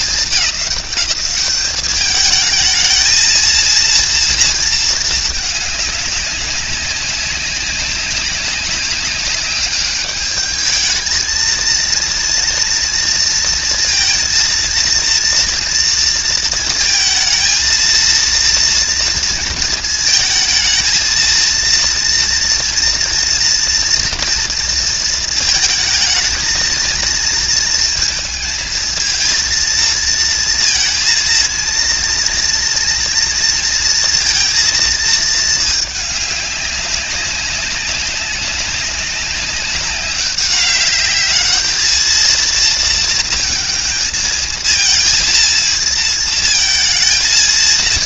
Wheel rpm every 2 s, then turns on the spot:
200, 220, 230, 200, 200, 210, 230, 230, 220, 230, 230, 240, 230, 220, 220, 230, 240, 230, 200, 190, 200, 230, 230, 230.
none